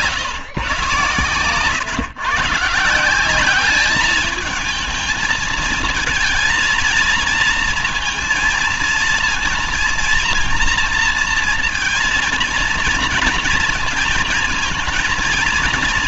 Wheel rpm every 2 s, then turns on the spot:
130, 160, 220, 230, 230, 230, 230, 230.
none